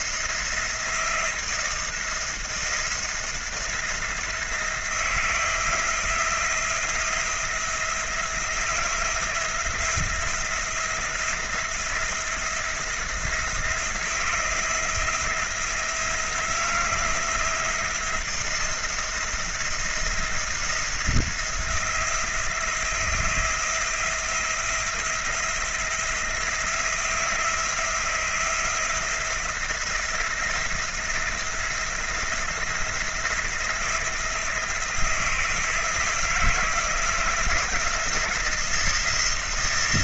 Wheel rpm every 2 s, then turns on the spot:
170, 170, 170, 170, 170, 170, 170, 170, 170, 170, 170, 170, 170, 170, 170, 170, 170, 170, 160, 170.
none